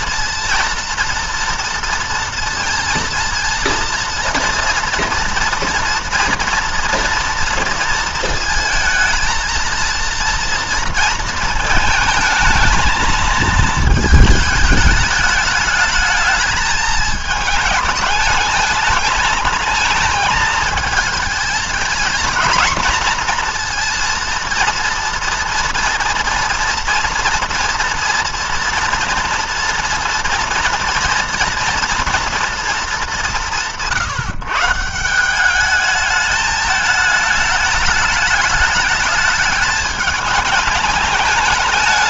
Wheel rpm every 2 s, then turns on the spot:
240, 230, 230, 230, 220, 230, 220, 220, 220, 220, 220, 230, 230, 230, 230, 230, 230, 150, 210, 210, 210.
none